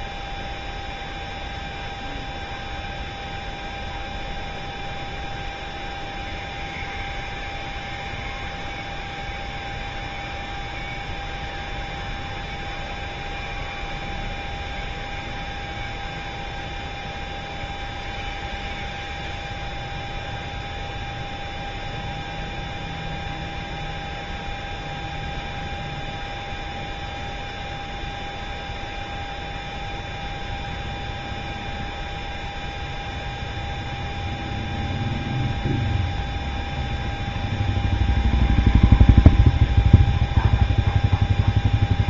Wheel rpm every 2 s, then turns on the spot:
0, 0, 0, 0, 0, 0, 0, 0, 0, 0, 0, 0, 0, 0, 0, 0, 0, 0, 0, 0, 0.
none